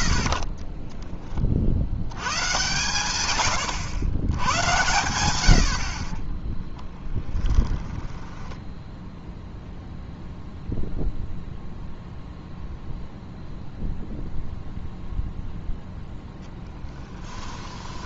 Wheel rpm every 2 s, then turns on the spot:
30, 120, 110, 10, 0, 0, 0, 0, 10.
6-8